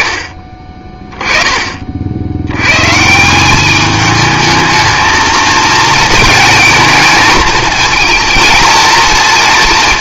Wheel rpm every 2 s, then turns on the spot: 30, 120, 220, 220, 230.
none